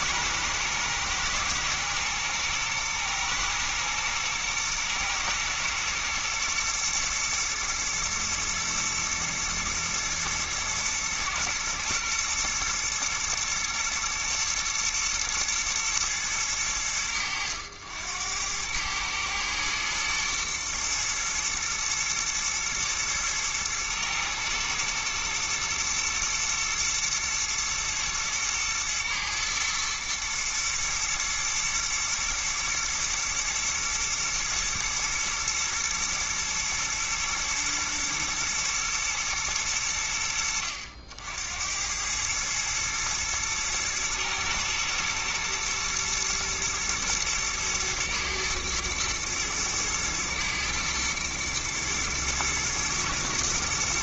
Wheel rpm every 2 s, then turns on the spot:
120, 110, 120, 120, 120, 110, 110, 110, 90, 100, 120, 110, 110, 120, 110, 120, 110, 120, 110, 110, 70, 110, 110, 110, 120, 110, 120.
none